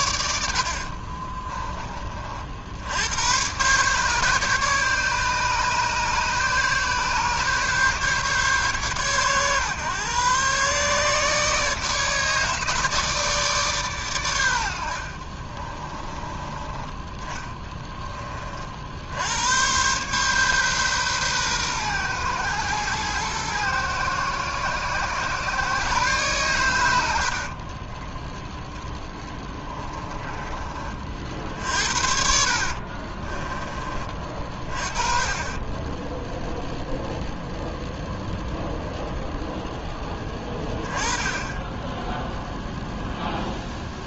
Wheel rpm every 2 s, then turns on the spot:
50, 90, 150, 140, 120, 140, 150, 50, 20, 80, 130, 120, 120, 80, 10, 40, 40, 30, 0, 0, 10, 0.
0-2 14-16 28-30 32-34